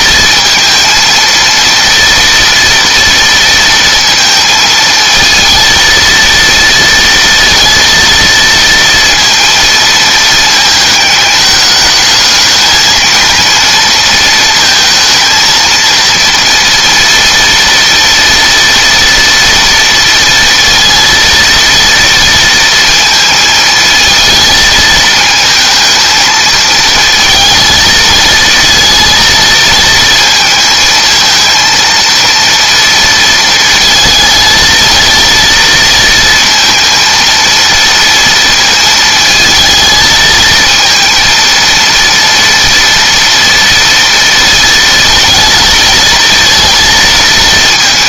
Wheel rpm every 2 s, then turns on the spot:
230, 230, 230, 230, 230, 220, 220, 230, 230, 230, 230, 230, 220, 220, 230, 220, 230, 220, 230, 220, 220, 230, 230, 230.
none